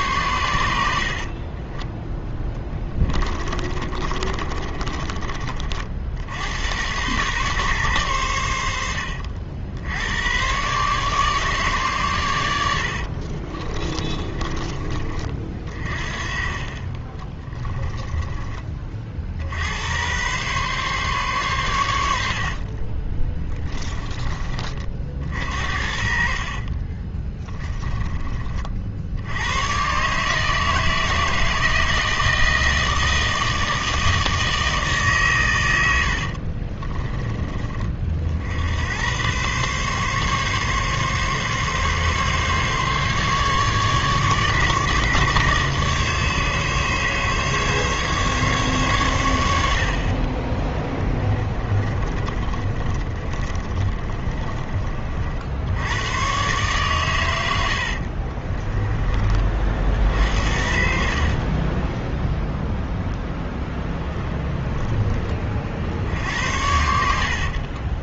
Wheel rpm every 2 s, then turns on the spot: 90, 20, 30, 100, 90, 120, 80, 20, 30, 20, 130, 50, 30, 40, 40, 160, 160, 160, 40, 80, 140, 140, 140, 140, 130, 20, 40, 30, 130, 20, 60, 0, 10, 70.
2-6 16-18 22-24 26-28 36-38 52-56 58-62